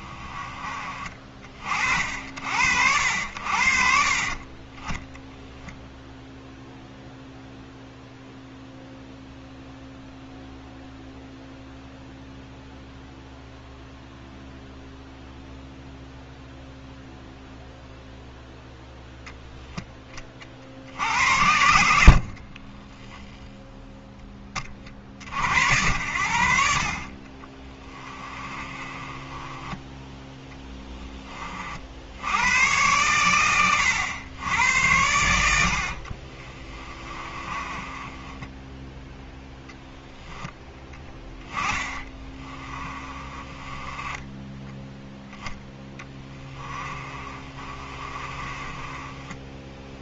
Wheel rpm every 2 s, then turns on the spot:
30, 70, 10, 0, 0, 0, 0, 0, 0, 0, 60, 10, 40, 40, 20, 20, 110, 90, 30, 10, 10, 20, 10, 20, 20.
22-24 28-30 36-38 42-44 46-50